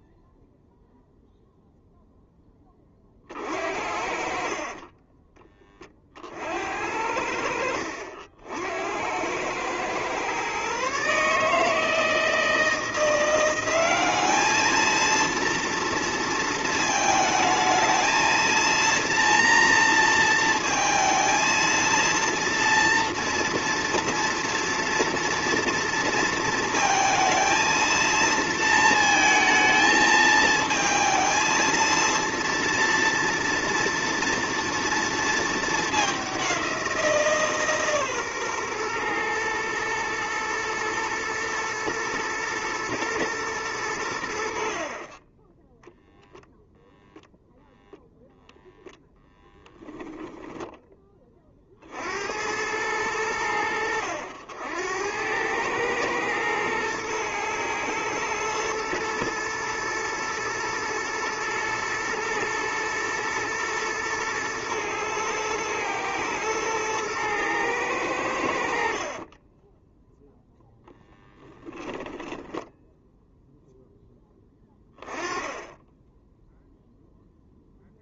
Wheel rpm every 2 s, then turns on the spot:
0, 20, 30, 60, 70, 130, 160, 220, 230, 230, 230, 230, 230, 230, 230, 220, 230, 230, 190, 130, 120, 110, 60, 0, 0, 10, 90, 90, 110, 110, 110, 110, 110, 110, 70, 0, 10, 10, 0.
72-74